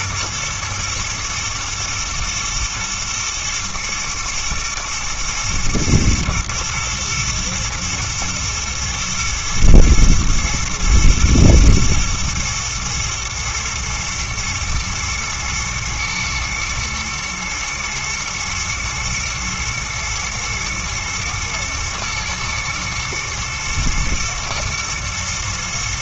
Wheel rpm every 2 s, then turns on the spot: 110, 120, 120, 110, 110, 110, 110, 110, 110, 120, 120, 110, 120.
none